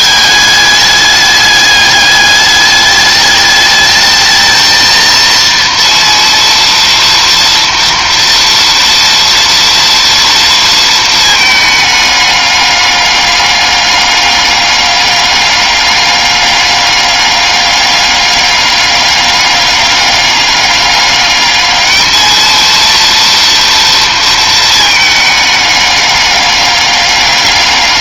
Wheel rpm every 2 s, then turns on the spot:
210, 210, 220, 230, 230, 230, 210, 200, 200, 200, 200, 220, 230, 200.
none